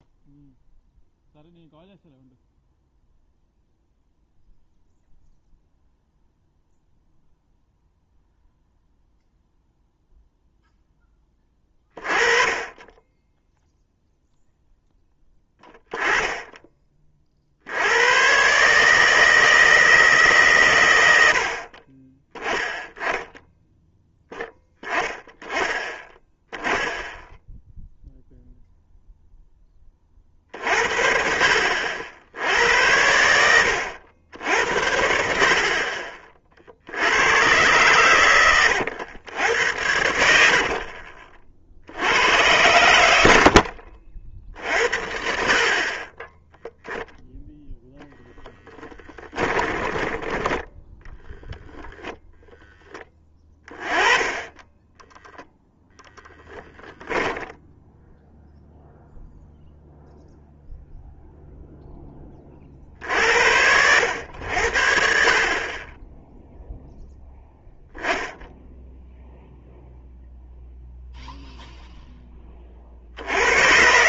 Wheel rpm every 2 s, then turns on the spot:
0, 0, 0, 0, 0, 10, 10, 10, 30, 150, 90, 10, 10, 10, 0, 50, 80, 60, 80, 90, 40, 100, 60, 0, 10, 0, 10, 10, 10, 0, 0, 50, 60, 10, 10, 0, 50.
40-42 48-50 56-58